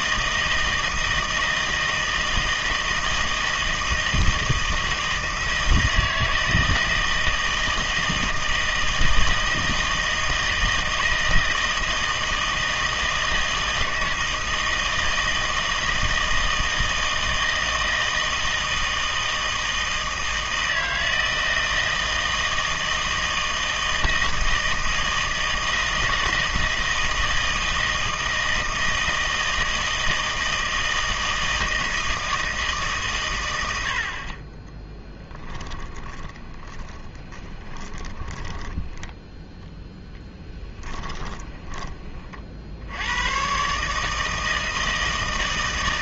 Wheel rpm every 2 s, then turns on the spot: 160, 160, 160, 160, 160, 160, 160, 160, 160, 160, 160, 160, 160, 160, 160, 160, 150, 10, 20, 10, 10, 60, 160.
34-42